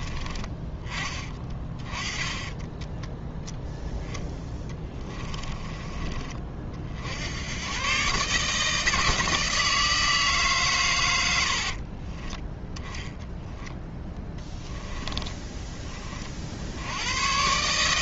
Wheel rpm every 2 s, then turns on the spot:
20, 10, 10, 50, 160, 120, 10, 10, 90.
4-6